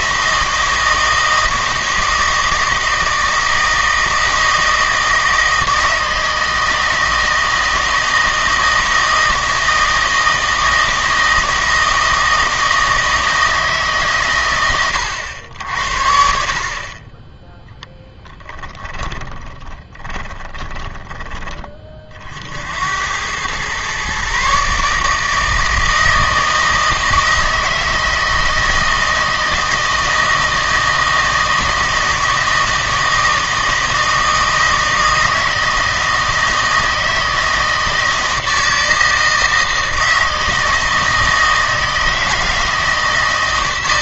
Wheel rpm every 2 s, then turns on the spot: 160, 160, 160, 160, 160, 160, 160, 120, 50, 30, 20, 60, 140, 160, 160, 160, 160, 160, 160, 160, 160, 160.
18-22